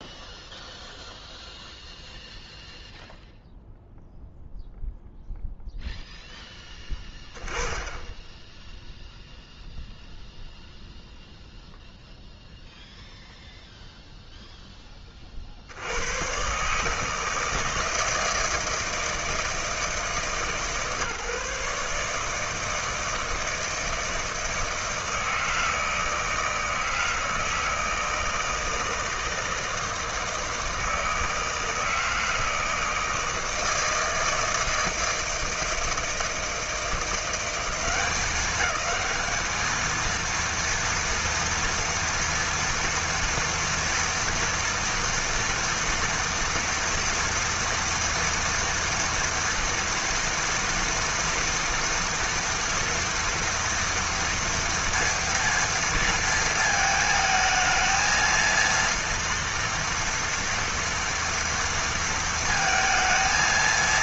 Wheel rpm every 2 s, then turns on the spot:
0, 0, 0, 10, 0, 0, 0, 10, 140, 160, 150, 160, 160, 160, 160, 160, 160, 160, 160, 190, 230, 230, 230, 240, 230, 230, 230, 230, 220, 230, 240, 230.
none